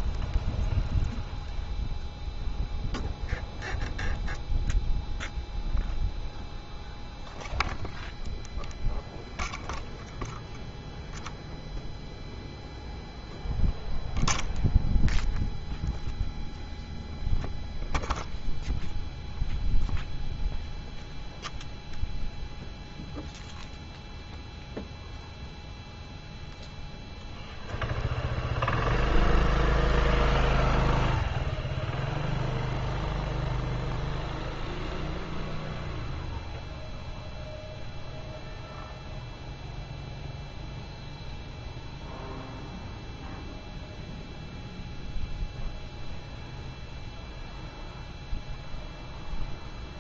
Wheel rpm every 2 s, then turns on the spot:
0, 0, 0, 0, 0, 0, 0, 0, 0, 0, 0, 0, 0, 0, 0, 0, 0, 0, 0, 0, 0, 0, 0, 0, 0.
none